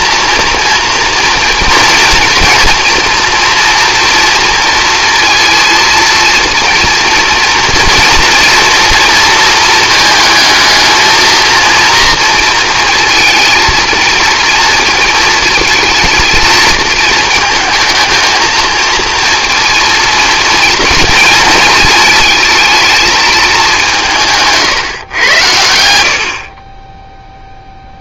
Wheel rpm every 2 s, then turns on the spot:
230, 230, 230, 240, 230, 220, 230, 230, 220, 220, 230, 220, 140, 30.
none